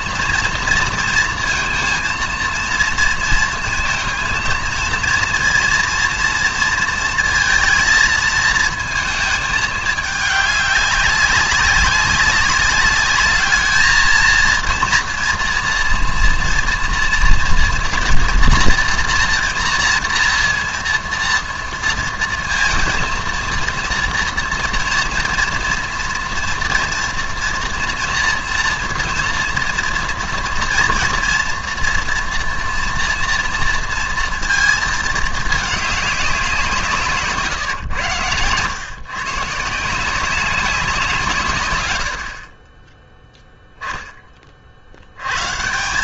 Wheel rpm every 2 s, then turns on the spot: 230, 230, 230, 230, 220, 200, 200, 230, 230, 240, 230, 230, 230, 240, 230, 230, 230, 230, 170, 110, 180, 30, 50.
none